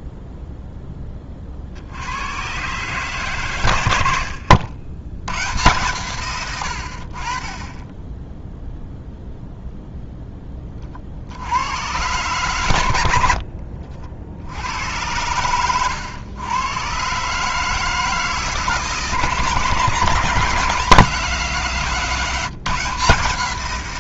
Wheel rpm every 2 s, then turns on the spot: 0, 130, 70, 90, 0, 30, 100, 90, 120, 160, 170, 170.
none